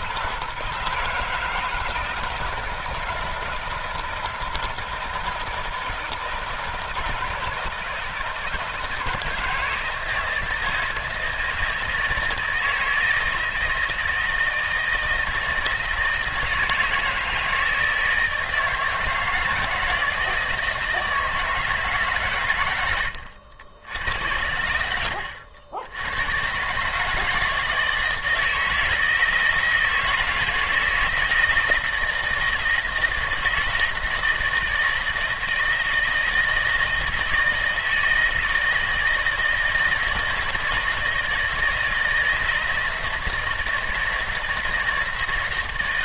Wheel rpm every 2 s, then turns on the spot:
160, 160, 160, 160, 160, 160, 160, 160, 160, 160, 160, 110, 90, 130, 160, 170, 160, 160, 160, 160, 160, 160, 160.
none